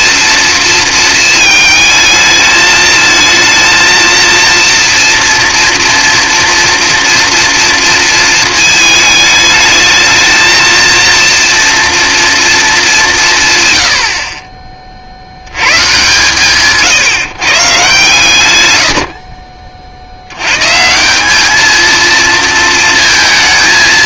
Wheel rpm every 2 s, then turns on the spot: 230, 220, 230, 230, 220, 230, 210, 40, 140, 70, 150, 230.
none